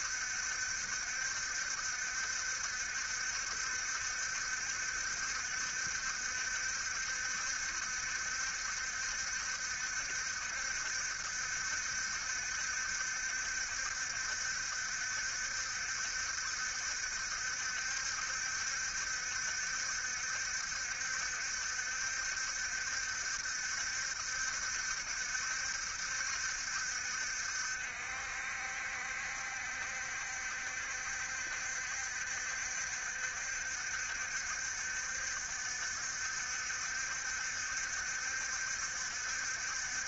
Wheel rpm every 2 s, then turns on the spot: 70, 70, 70, 70, 70, 70, 70, 70, 70, 70, 70, 70, 70, 60, 60, 60, 60, 70, 70, 70.
none